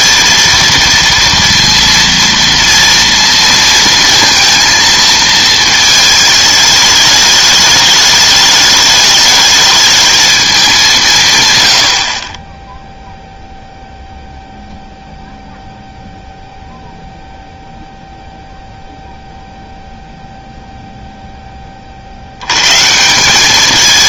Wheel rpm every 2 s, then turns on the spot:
230, 230, 230, 210, 210, 200, 10, 0, 0, 0, 0, 130.
none